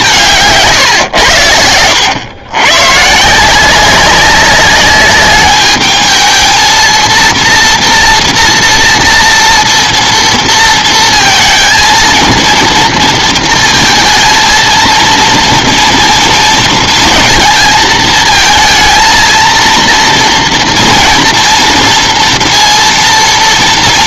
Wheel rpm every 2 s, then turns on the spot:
140, 120, 200, 220, 230, 230, 230, 230, 230, 230, 230, 240.
none